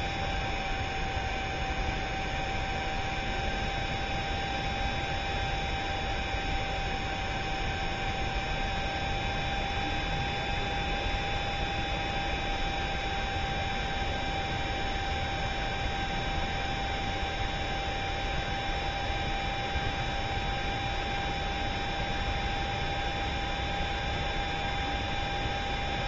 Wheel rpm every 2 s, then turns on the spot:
0, 0, 0, 0, 0, 0, 0, 0, 0, 0, 0, 0, 0.
none